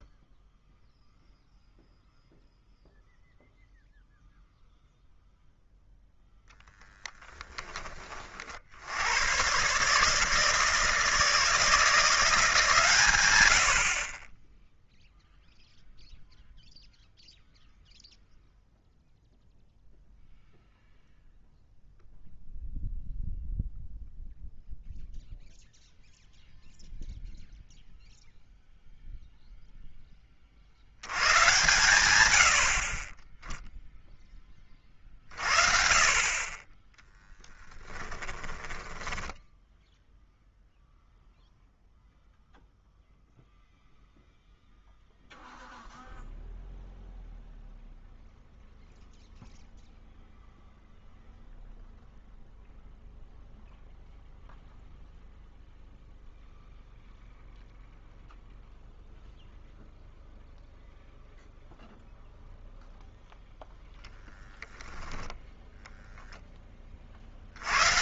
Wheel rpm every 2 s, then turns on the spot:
0, 0, 0, 10, 50, 150, 150, 10, 0, 0, 0, 0, 0, 0, 0, 50, 70, 30, 20, 20, 0, 0, 0, 0, 0, 0, 0, 0, 0, 0, 0, 0, 0, 20.
6-8 38-40